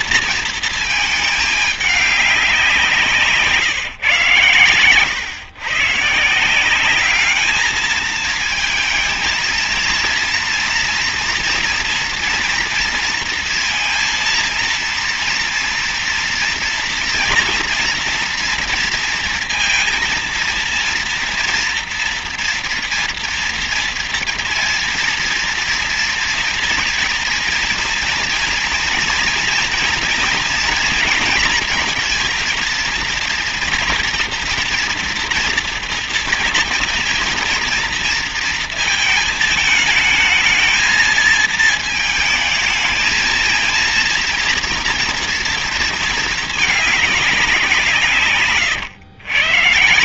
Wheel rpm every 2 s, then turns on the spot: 230, 190, 130, 170, 220, 230, 230, 230, 240, 230, 230, 230, 240, 240, 240, 230, 230, 240, 230, 220, 220, 220, 230, 220, 150.
none